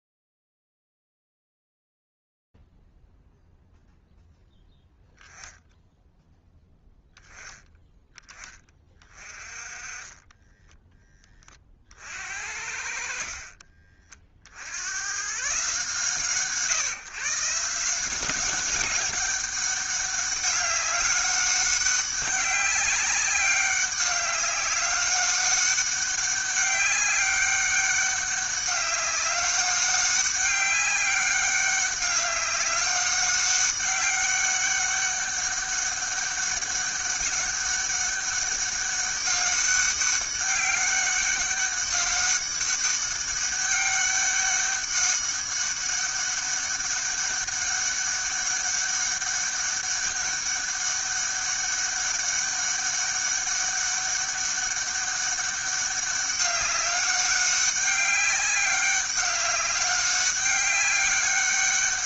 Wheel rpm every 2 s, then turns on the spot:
0, 0, 0, 0, 20, 10, 60, 60, 130, 190, 200, 200, 190, 200, 200, 200, 200, 200, 200, 200, 200, 200, 200, 200, 200, 200, 200, 200, 200, 200, 200.
none